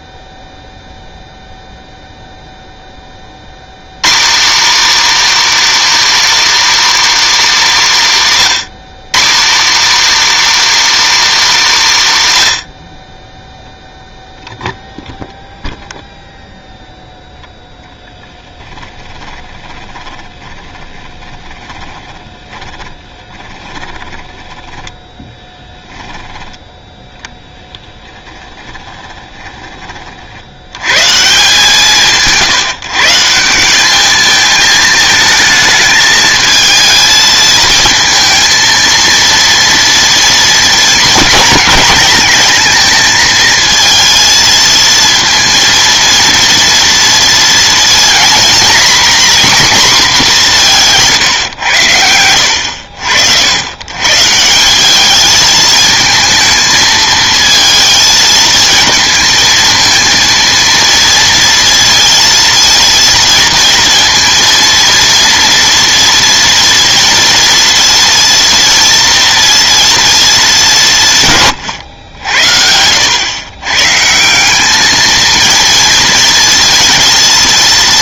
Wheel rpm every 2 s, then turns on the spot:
0, 50, 310, 310, 220, 300, 30, 0, 0, 10, 10, 20, 20, 10, 20, 120, 150, 220, 220, 230, 230, 220, 230, 230, 250, 170, 70, 200, 220, 230, 230, 230, 230, 230, 230, 170, 80, 210, 230.
18-26 28-30